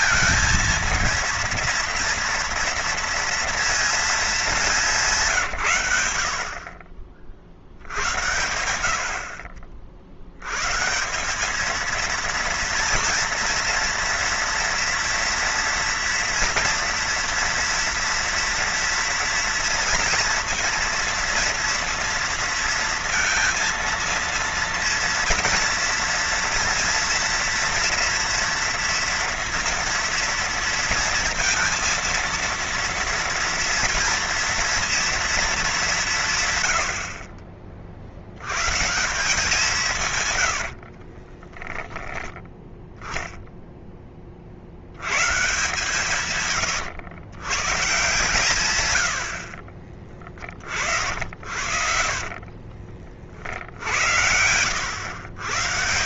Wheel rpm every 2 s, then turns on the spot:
230, 230, 210, 60, 80, 120, 230, 230, 230, 230, 230, 230, 230, 230, 230, 230, 230, 240, 100, 120, 80, 10, 50, 110, 120, 40, 30, 90.
40-42 46-48 52-54